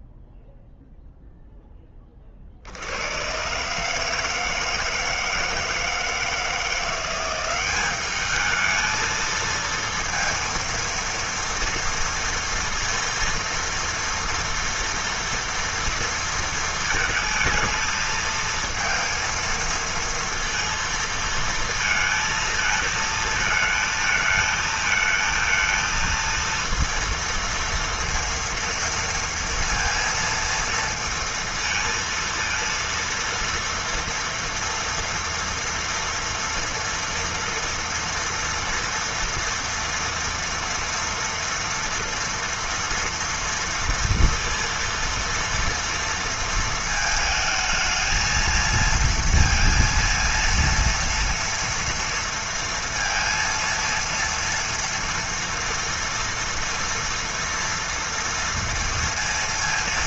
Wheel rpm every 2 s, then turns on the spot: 0, 70, 160, 170, 220, 230, 230, 230, 230, 230, 230, 220, 220, 230, 230, 230, 230, 230, 230, 230, 230, 230, 230, 220, 230, 230, 230, 230, 230, 230.
none